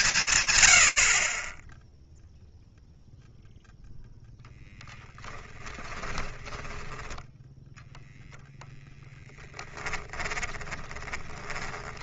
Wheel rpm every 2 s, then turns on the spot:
60, 0, 20, 0, 10, 10.
4-6 8-10